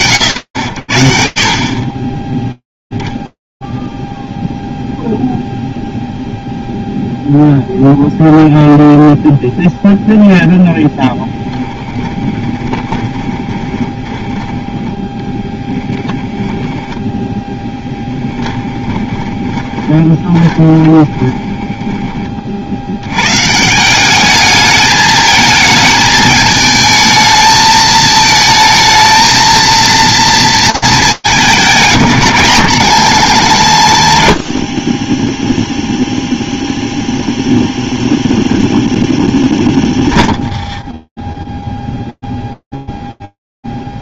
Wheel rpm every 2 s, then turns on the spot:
80, 0, 0, 0, 0, 10, 20, 20, 10, 20, 10, 120, 220, 220, 220, 210, 110, 10, 0, 0, 0, 0.
10-14 18-22